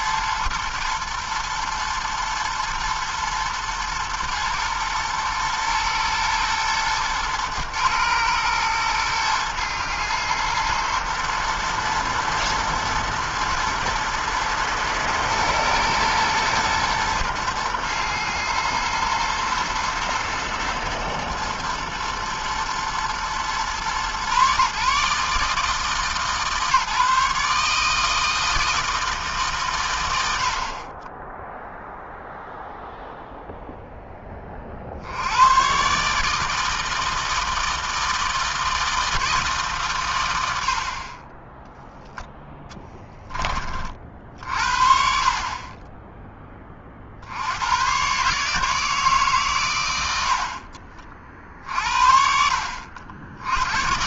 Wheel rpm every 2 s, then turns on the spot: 110, 120, 120, 110, 110, 110, 110, 110, 120, 110, 120, 120, 150, 150, 160, 20, 0, 80, 160, 160, 30, 20, 50, 60, 150, 50, 70.
none